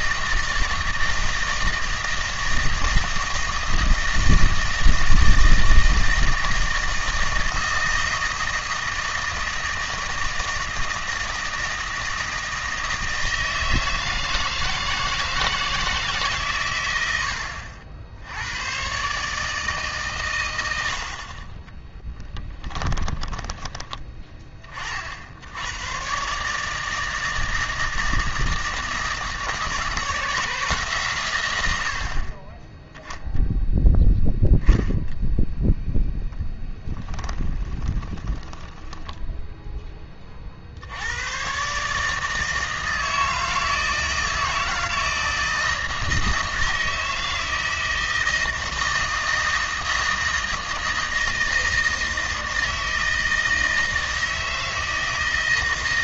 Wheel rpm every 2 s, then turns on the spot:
160, 160, 160, 160, 160, 160, 160, 160, 110, 110, 90, 20, 40, 160, 160, 160, 10, 0, 10, 10, 60, 160, 160, 160, 160, 160, 160, 160.
22-24 36-40